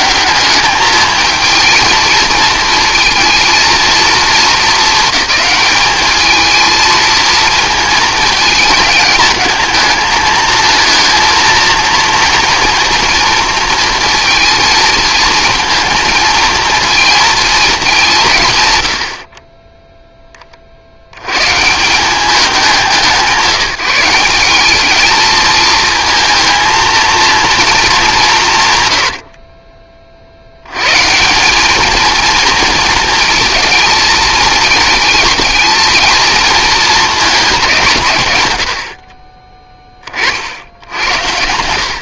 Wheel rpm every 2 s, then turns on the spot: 210, 230, 220, 220, 220, 220, 230, 230, 230, 100, 60, 190, 200, 230, 110, 100, 220, 220, 220, 90, 70.
28-30 38-40